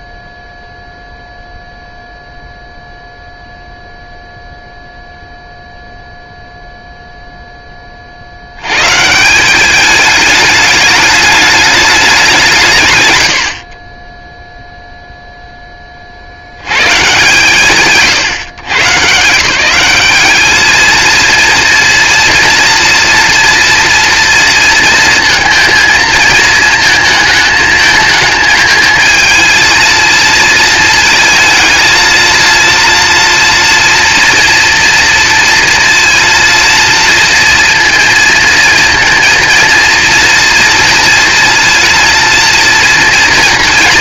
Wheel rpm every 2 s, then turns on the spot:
0, 0, 0, 0, 120, 210, 140, 0, 60, 130, 220, 230, 230, 220, 220, 220, 230, 230, 230, 230, 230, 240.
none